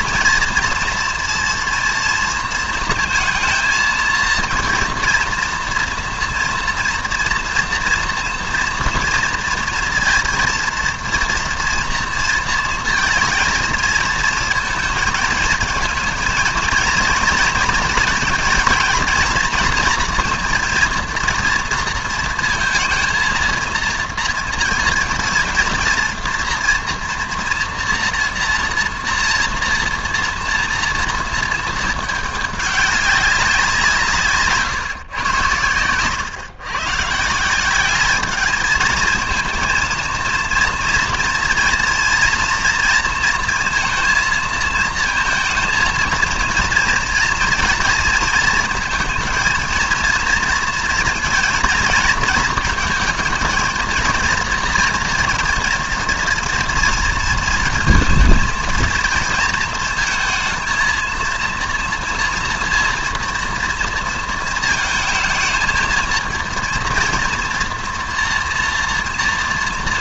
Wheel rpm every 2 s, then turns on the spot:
230, 220, 230, 230, 230, 230, 230, 220, 230, 230, 230, 230, 230, 230, 230, 230, 200, 150, 120, 220, 230, 230, 230, 230, 230, 230, 220, 230, 230, 230, 220, 240, 230, 230, 240.
none